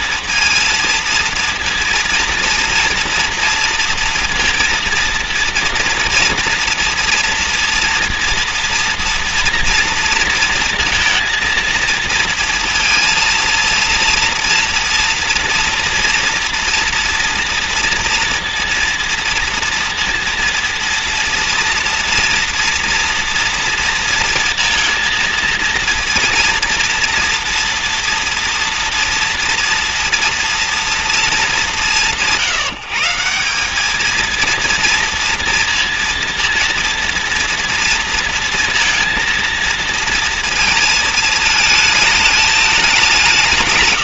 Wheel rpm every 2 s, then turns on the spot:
230, 230, 230, 230, 230, 230, 230, 230, 230, 230, 230, 230, 230, 230, 230, 230, 170, 230, 230, 230, 230, 210.
none